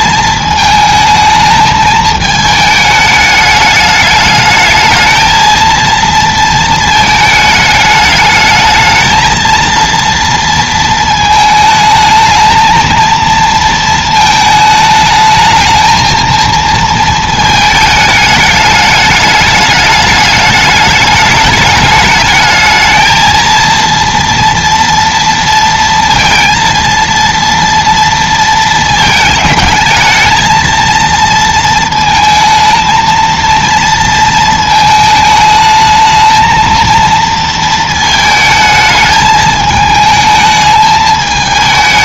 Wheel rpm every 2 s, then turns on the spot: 220, 210, 220, 230, 220, 230, 230, 220, 230, 210, 210, 220, 230, 230, 220, 230, 220, 220, 230, 220, 220.
none